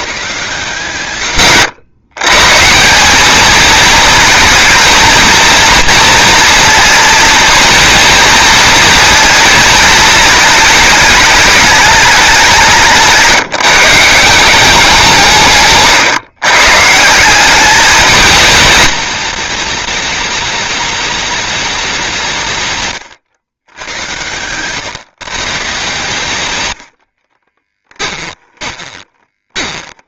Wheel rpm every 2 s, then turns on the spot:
140, 160, 230, 230, 230, 210, 190, 190, 140, 220, 210, 150, 130, 110, 20.
28-30